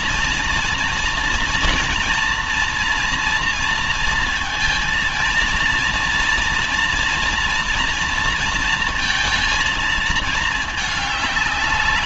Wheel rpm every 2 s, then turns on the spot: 240, 240, 230, 240, 230, 220.
none